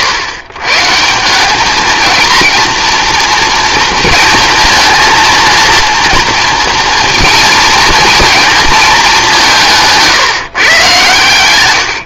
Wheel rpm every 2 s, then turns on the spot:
140, 230, 230, 230, 220, 130.
none